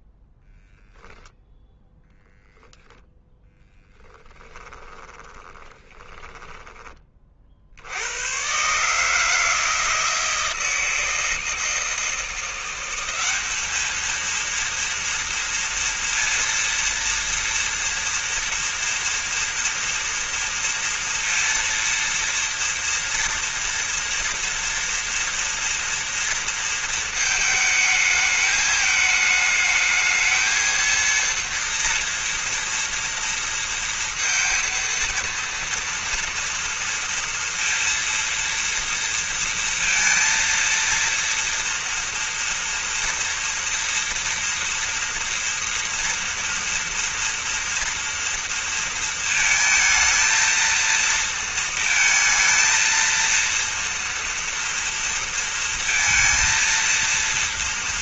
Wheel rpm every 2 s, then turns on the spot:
0, 10, 20, 20, 120, 160, 180, 230, 230, 230, 230, 230, 230, 230, 210, 220, 230, 230, 230, 230, 230, 230, 230, 240, 230, 230, 230, 230, 230.
4-8